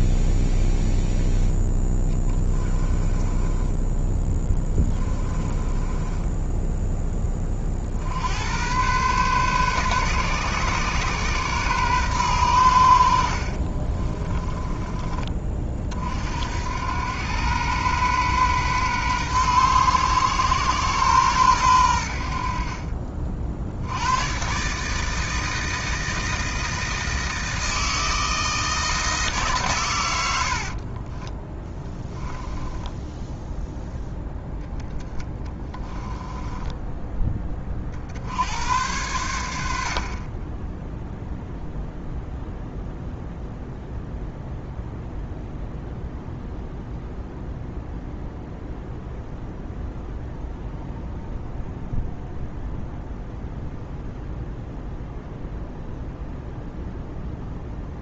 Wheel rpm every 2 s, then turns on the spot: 0, 20, 20, 10, 110, 130, 80, 20, 90, 120, 130, 50, 150, 160, 160, 50, 10, 0, 10, 90, 10, 0, 0, 0, 0, 0, 0, 0, 0.
2-6 30-34